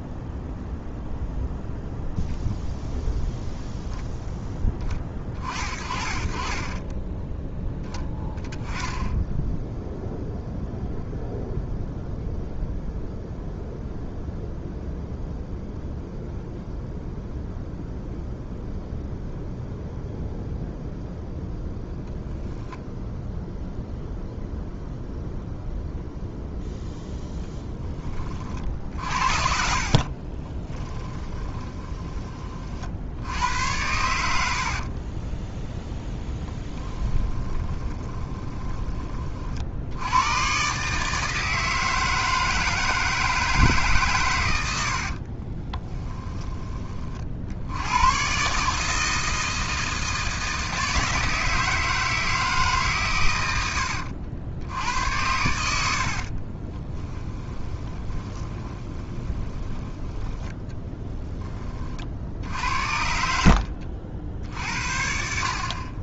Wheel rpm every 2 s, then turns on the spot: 0, 0, 20, 30, 10, 0, 0, 0, 0, 0, 0, 0, 0, 0, 50, 20, 50, 60, 10, 20, 130, 160, 80, 20, 150, 160, 150, 80, 30, 20, 10, 70, 60.
30-32 34-40 44-46 56-60